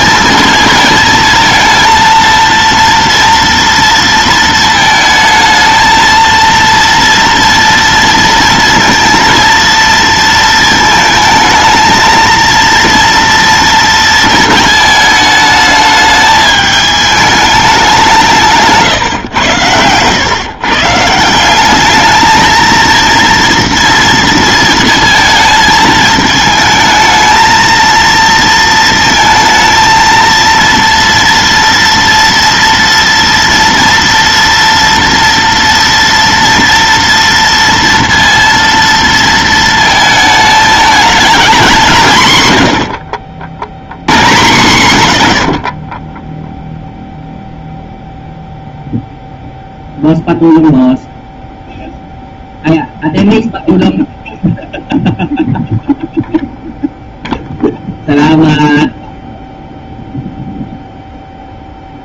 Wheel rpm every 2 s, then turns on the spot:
220, 230, 220, 230, 230, 220, 230, 220, 210, 160, 140, 230, 230, 220, 230, 230, 230, 240, 230, 230, 220, 100, 120, 0, 0, 0, 0, 0, 0, 0, 0.
none